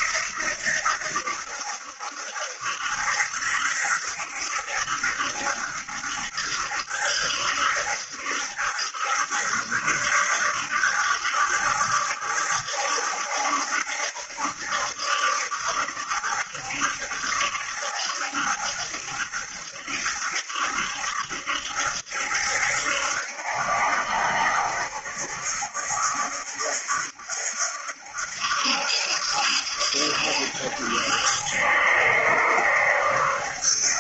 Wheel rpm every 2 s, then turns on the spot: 80, 70, 70, 70, 70, 70, 70, 70, 70, 70, 70, 70, 70, 70, 70, 70, 70.
none